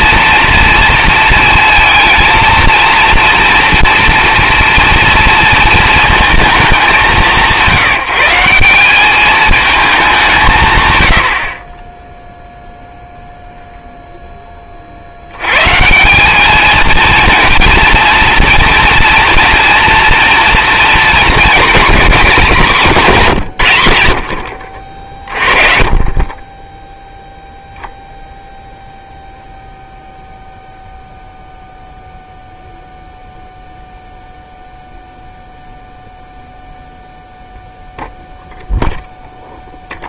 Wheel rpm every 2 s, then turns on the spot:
230, 230, 240, 210, 180, 140, 0, 30, 220, 230, 230, 180, 50, 10, 0, 0, 0, 0, 0, 0.
none